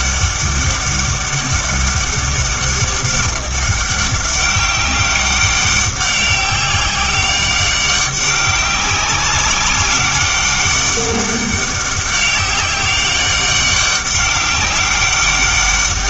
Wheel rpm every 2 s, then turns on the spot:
200, 200, 200, 200, 190, 200, 200, 200.
none